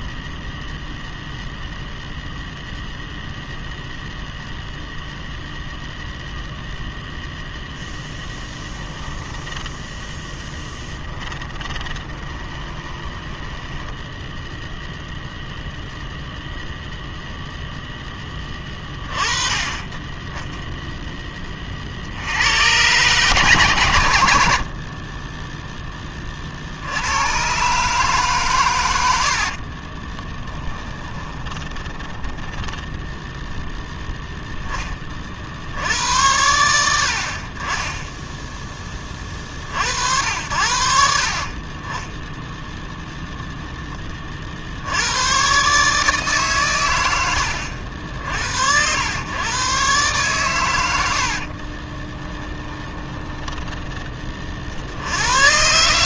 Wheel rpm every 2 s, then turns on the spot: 0, 0, 0, 0, 10, 10, 20, 0, 0, 20, 10, 110, 40, 60, 110, 20, 10, 10, 80, 10, 70, 10, 80, 110, 90, 90, 20, 50.
8-14 30-34 52-54